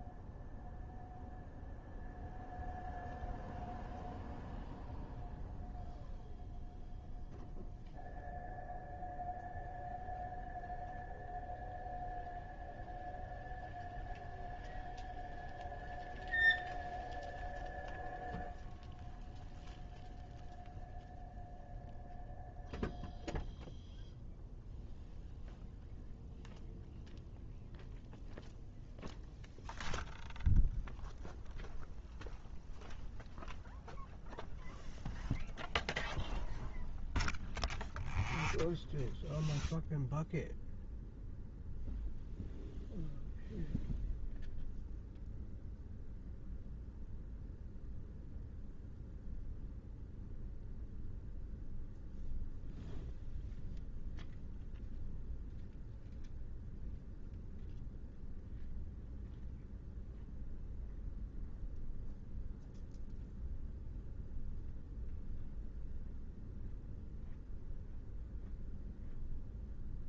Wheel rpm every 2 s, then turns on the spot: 0, 0, 0, 0, 0, 0, 0, 0, 0, 0, 0, 0, 0, 0, 0, 0, 0, 0, 0, 0, 0, 0, 0, 0, 0, 0, 0, 0, 0, 0, 0, 0, 0, 0, 0.
none